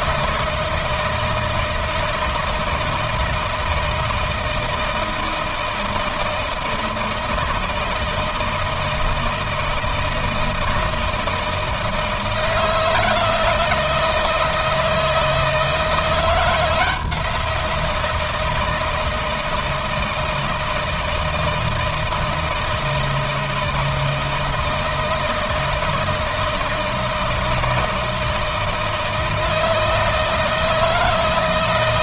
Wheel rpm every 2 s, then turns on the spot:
160, 160, 160, 160, 160, 160, 160, 160, 170, 160, 160, 160, 160, 160, 160, 160.
none